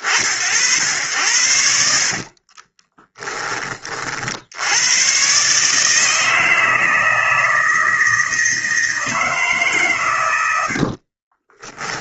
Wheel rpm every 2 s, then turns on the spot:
80, 10, 110, 160, 160, 30.
10-12